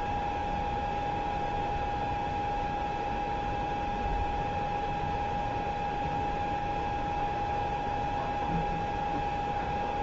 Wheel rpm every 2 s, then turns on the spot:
0, 0, 0, 0, 0.
none